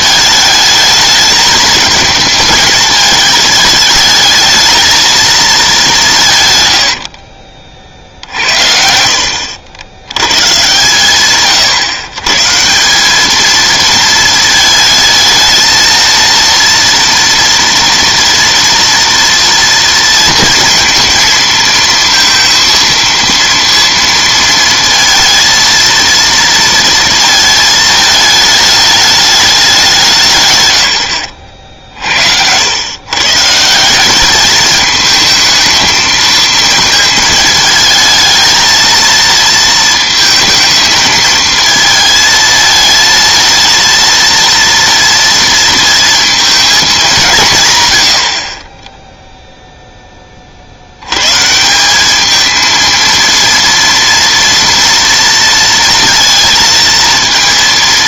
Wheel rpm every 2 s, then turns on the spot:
220, 220, 220, 130, 60, 130, 160, 220, 230, 230, 230, 230, 230, 230, 210, 140, 90, 210, 220, 220, 220, 220, 230, 220, 40, 50, 220, 230, 230.
none